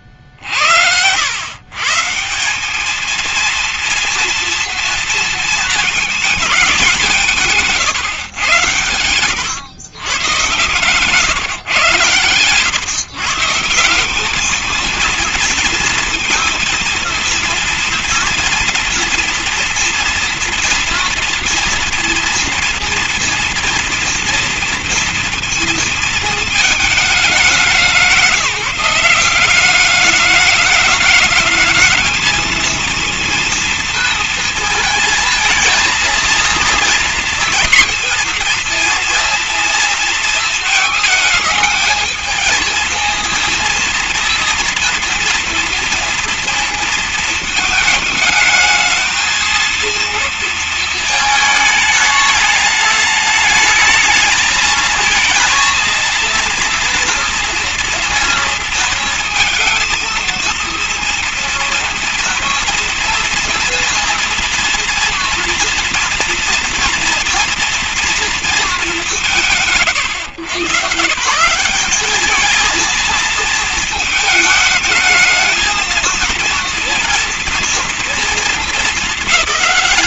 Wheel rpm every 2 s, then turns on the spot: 60, 180, 230, 210, 110, 110, 130, 210, 230, 230, 230, 230, 230, 220, 180, 210, 220, 230, 220, 230, 230, 220, 230, 230, 220, 230, 220, 220, 230, 230, 230, 240, 230, 240, 230, 120, 210, 210, 230, 220.
none